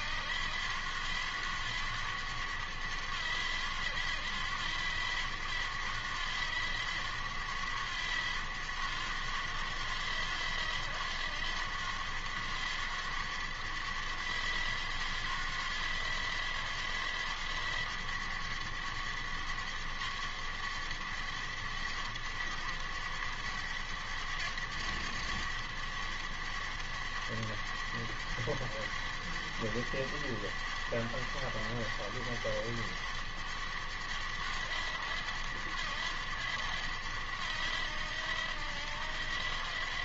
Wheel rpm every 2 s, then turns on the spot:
90, 100, 90, 90, 100, 90, 100, 90, 90, 100, 100, 100, 100, 100, 100, 100, 100, 100, 100, 90.
none